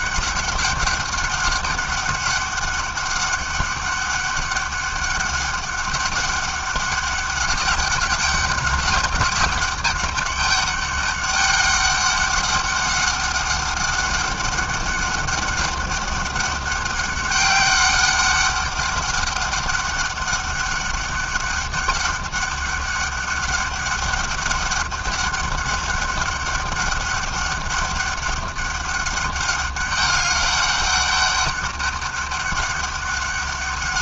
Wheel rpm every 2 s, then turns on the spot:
200, 200, 200, 200, 200, 200, 200, 200, 200, 200, 200, 200, 200, 200, 200, 200, 190.
none